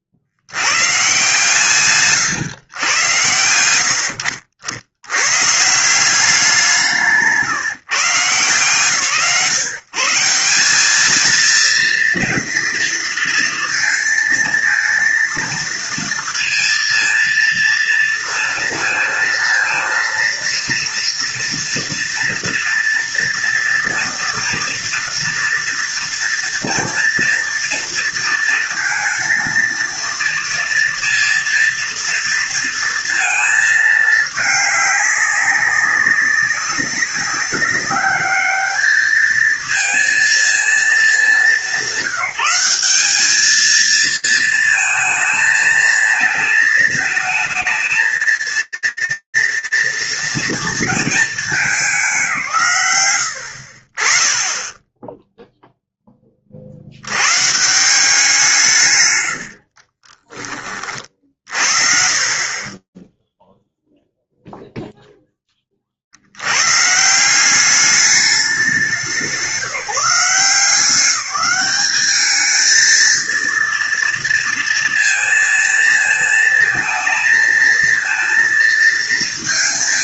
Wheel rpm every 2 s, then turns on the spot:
60, 130, 70, 180, 140, 180, 230, 230, 230, 230, 230, 230, 230, 230, 230, 230, 230, 210, 190, 210, 230, 190, 220, 220, 230, 220, 90, 0, 100, 140, 30, 10, 10, 180, 180, 190, 230, 230, 220, 220.
58-64